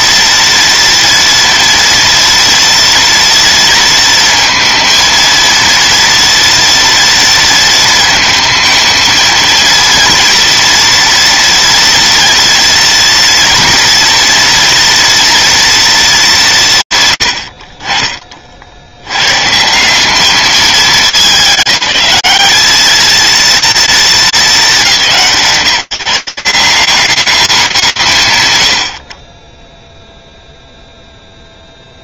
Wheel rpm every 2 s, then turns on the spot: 230, 230, 230, 230, 220, 230, 230, 230, 120, 80, 210, 220, 170, 180, 90, 0.
none